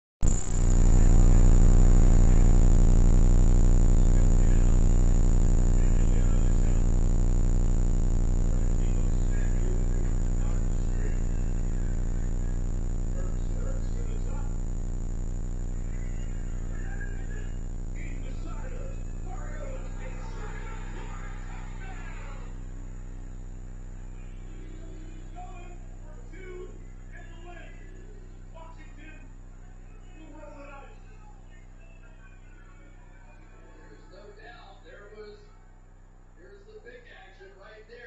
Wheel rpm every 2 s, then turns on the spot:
0, 0, 0, 0, 0, 0, 0, 0, 0, 0, 0, 0, 0, 0, 0, 0, 0, 0, 0.
none